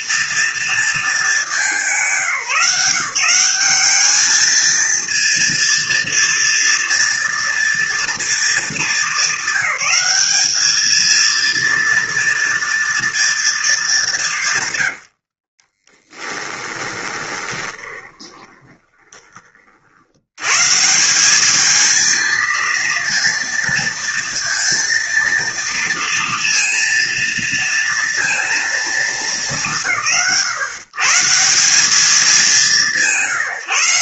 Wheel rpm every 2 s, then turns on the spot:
230, 170, 230, 230, 210, 220, 230, 110, 20, 20, 150, 230, 230, 230, 230, 150, 150.
14-20